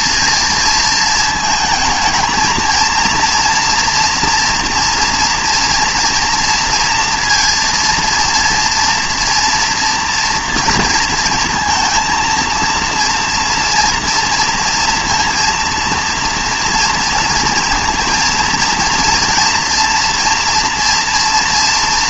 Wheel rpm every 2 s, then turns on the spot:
220, 230, 240, 230, 230, 230, 230, 230, 230, 230, 230.
none